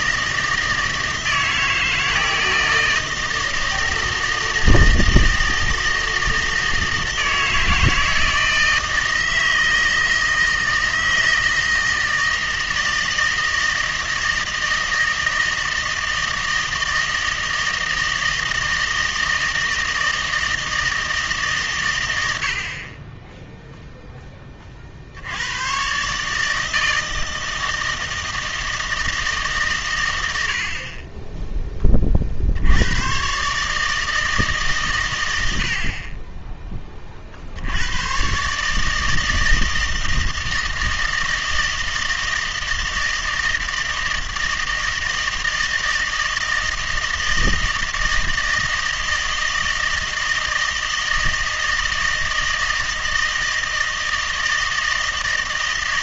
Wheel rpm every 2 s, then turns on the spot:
160, 160, 160, 160, 160, 160, 160, 160, 160, 160, 160, 50, 40, 160, 160, 30, 90, 130, 20, 150, 160, 160, 160, 160, 160, 160, 160, 160.
none